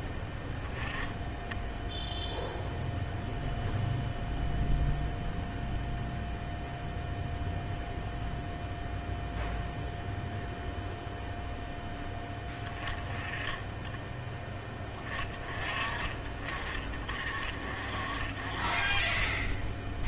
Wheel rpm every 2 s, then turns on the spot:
10, 0, 0, 0, 0, 0, 20, 10, 30, 30.
none